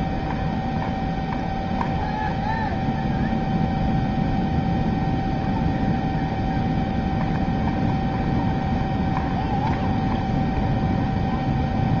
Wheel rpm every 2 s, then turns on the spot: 0, 0, 0, 0, 0, 0.
none